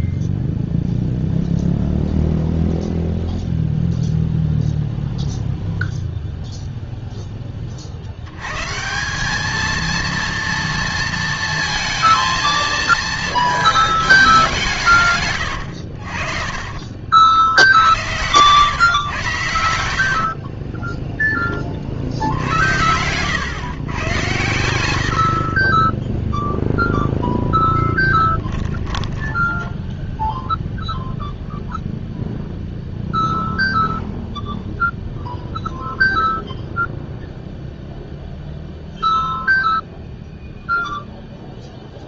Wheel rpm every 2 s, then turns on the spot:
0, 0, 0, 0, 120, 230, 230, 180, 40, 120, 30, 70, 100, 0, 10, 0, 0, 0, 0, 0, 0.
16-18 20-22 28-30